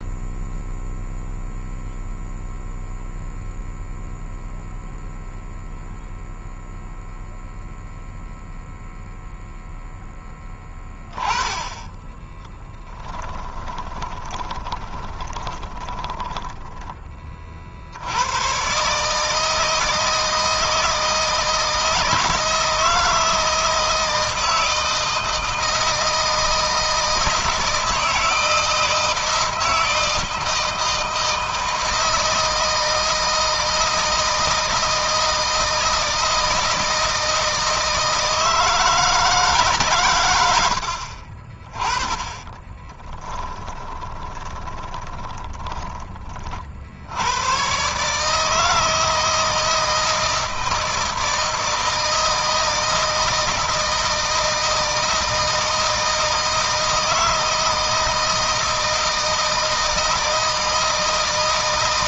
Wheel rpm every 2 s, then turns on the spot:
0, 0, 0, 0, 0, 10, 10, 20, 10, 130, 160, 160, 160, 160, 160, 160, 160, 160, 160, 160, 90, 20, 20, 50, 160, 160, 160, 160, 160, 160, 160.
12-16 42-46